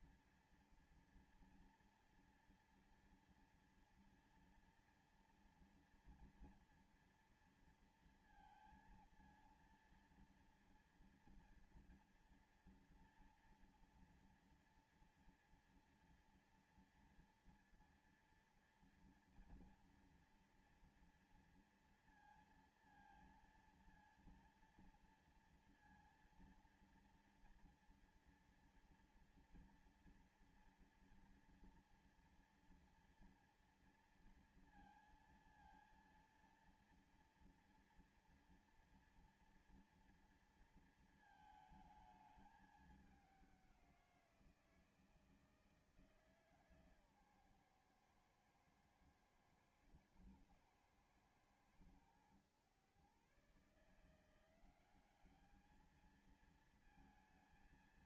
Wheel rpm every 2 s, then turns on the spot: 240, 230, 230, 230, 230, 230, 240, 230, 230, 230, 230, 230, 230, 230, 230, 230, 230, 230, 230, 230, 230, 210, 170, 150, 120, 110, 120, 190, 220.
none